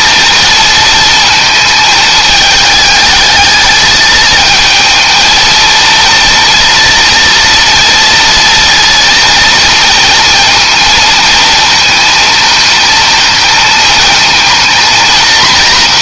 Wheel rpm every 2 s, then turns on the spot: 230, 220, 220, 230, 230, 230, 220, 230.
none